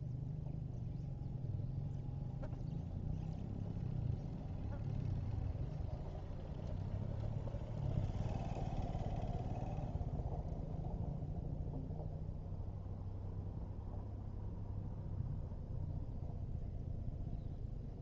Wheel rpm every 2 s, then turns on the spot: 0, 0, 0, 0, 0, 0, 0, 0, 0.
none